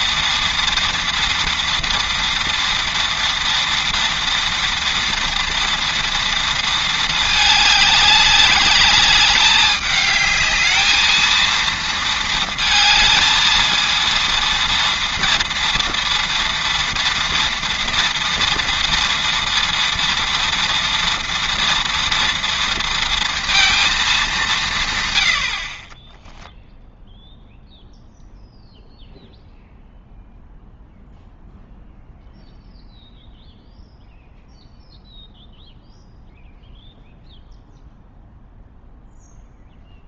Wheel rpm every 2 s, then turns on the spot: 230, 240, 230, 230, 200, 220, 220, 230, 230, 230, 230, 230, 170, 10, 0, 0, 0, 0, 0, 0.
none